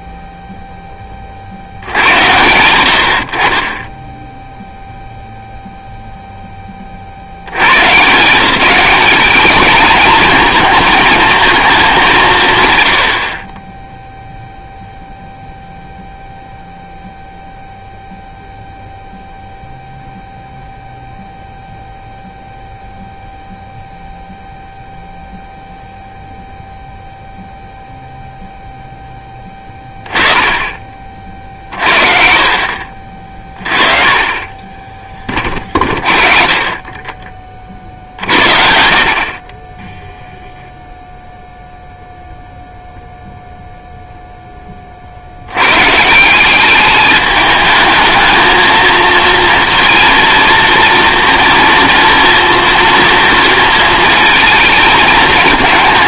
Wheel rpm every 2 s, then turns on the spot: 0, 80, 0, 10, 170, 220, 130, 0, 0, 0, 0, 0, 0, 0, 0, 20, 50, 20, 30, 60, 0, 0, 20, 200, 220, 230, 230, 220.
32-34